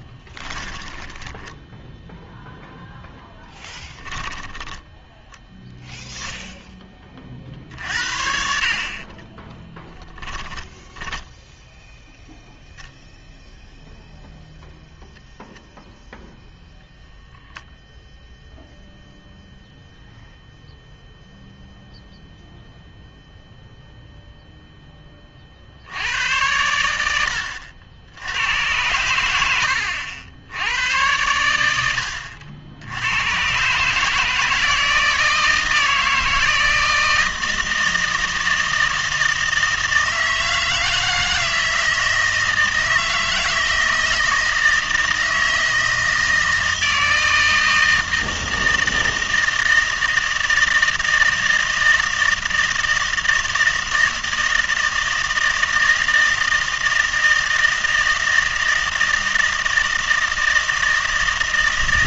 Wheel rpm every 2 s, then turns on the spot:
10, 0, 10, 10, 60, 10, 0, 0, 0, 0, 0, 0, 0, 90, 100, 90, 80, 160, 160, 160, 160, 160, 160, 160, 160, 160, 160, 160, 160, 160, 160.
0-2 4-6 8-12